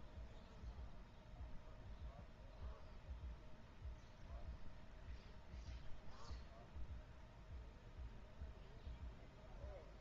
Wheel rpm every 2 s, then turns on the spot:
0, 0, 0, 0, 0.
none